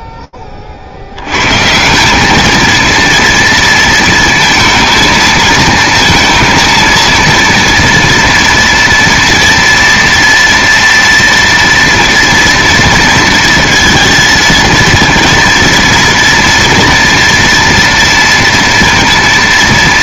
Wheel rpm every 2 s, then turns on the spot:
20, 220, 220, 230, 230, 230, 230, 230, 230, 230.
none